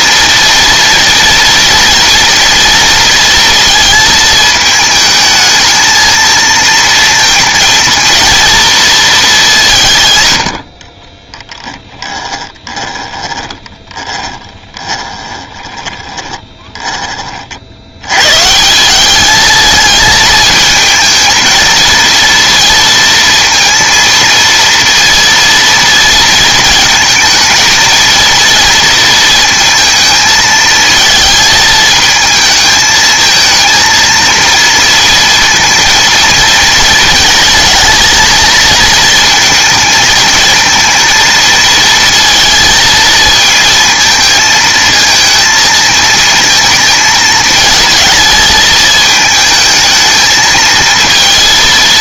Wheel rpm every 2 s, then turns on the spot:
230, 230, 220, 230, 230, 60, 20, 20, 10, 170, 220, 230, 230, 230, 230, 220, 220, 230, 230, 230, 230, 230, 220, 220, 220, 220.
12-18